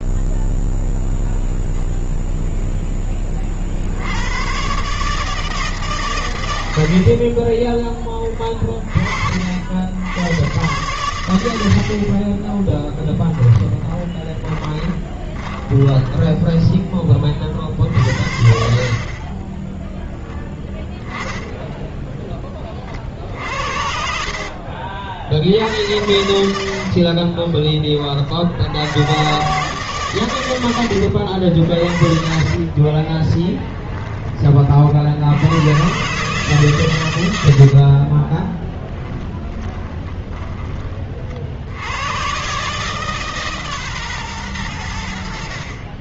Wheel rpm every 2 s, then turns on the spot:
0, 0, 110, 80, 30, 110, 10, 20, 20, 60, 10, 50, 50, 70, 80, 100, 40, 40, 120, 30, 30, 130, 110.
12-16 18-22 26-28 32-34 38-40